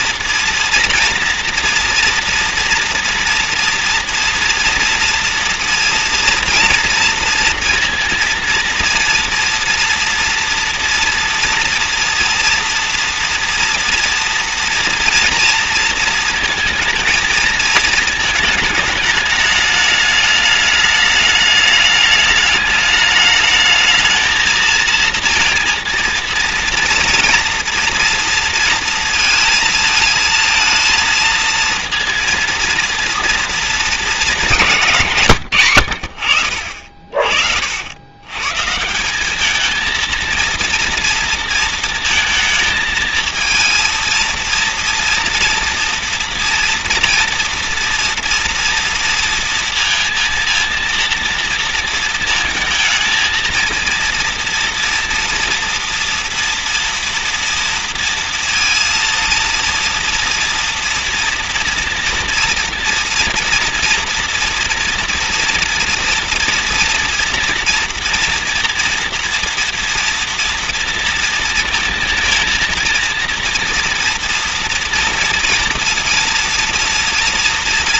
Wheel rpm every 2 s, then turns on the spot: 230, 230, 240, 230, 230, 230, 230, 230, 230, 220, 210, 210, 230, 230, 230, 220, 230, 180, 60, 130, 230, 220, 230, 230, 230, 230, 230, 230, 230, 230, 230, 230, 240, 240, 240, 230, 220, 230, 230.
none